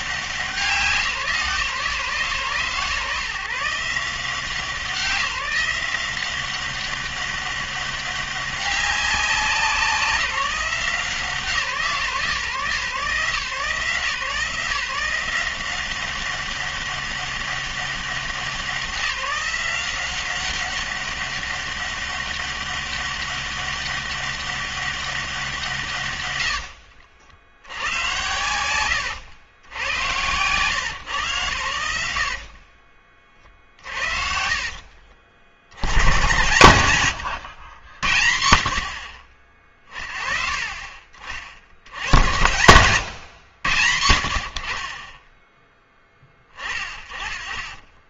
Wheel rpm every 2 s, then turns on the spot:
170, 130, 180, 190, 200, 170, 140, 170, 200, 190, 190, 200, 200, 80, 100, 120, 50, 50, 130, 90, 40, 110, 50, 30.
32-36